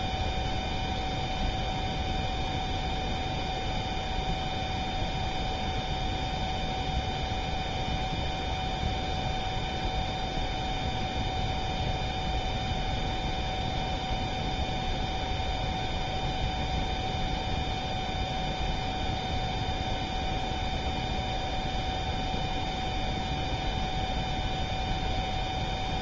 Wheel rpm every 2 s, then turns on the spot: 0, 0, 0, 0, 0, 0, 0, 0, 0, 0, 0, 0, 0.
none